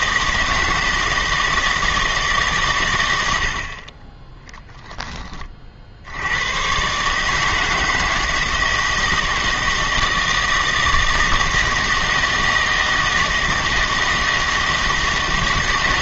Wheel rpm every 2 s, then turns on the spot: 160, 130, 10, 120, 160, 160, 160, 160.
none